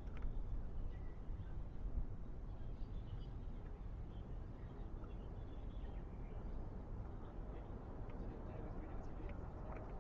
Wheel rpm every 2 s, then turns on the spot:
0, 0, 0, 0, 0.
none